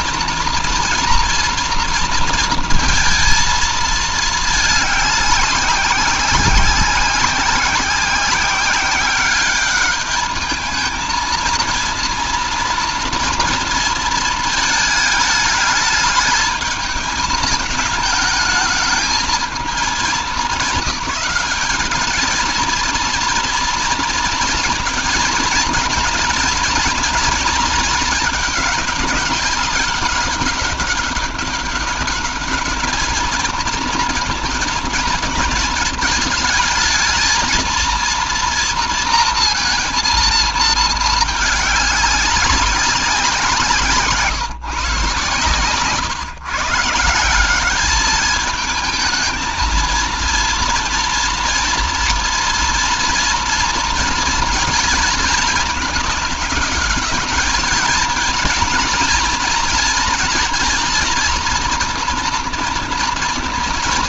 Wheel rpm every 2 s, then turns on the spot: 230, 230, 210, 190, 190, 220, 240, 220, 210, 220, 200, 220, 230, 240, 210, 200, 210, 230, 220, 230, 220, 190, 140, 160, 220, 230, 230, 230, 210, 230, 230, 230.
none